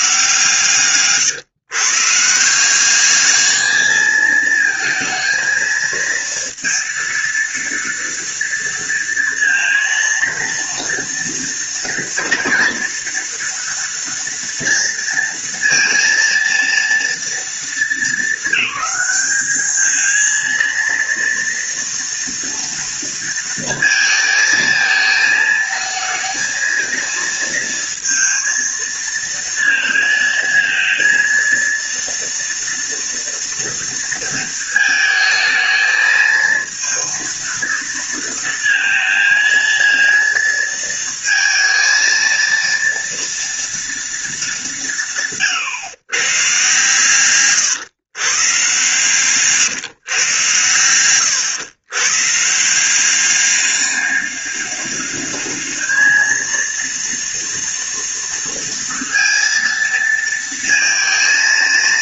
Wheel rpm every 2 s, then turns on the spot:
140, 160, 220, 230, 230, 230, 230, 230, 230, 220, 230, 230, 220, 220, 230, 230, 230, 230, 220, 230, 230, 230, 210, 120, 130, 120, 150, 200, 230, 230, 230.
none